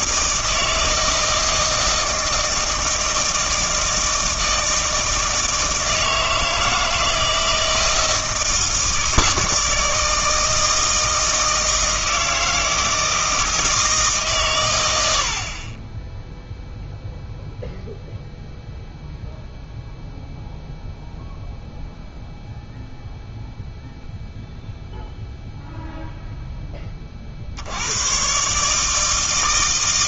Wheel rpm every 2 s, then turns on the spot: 160, 160, 160, 160, 160, 160, 160, 120, 0, 0, 0, 0, 0, 10, 150.
none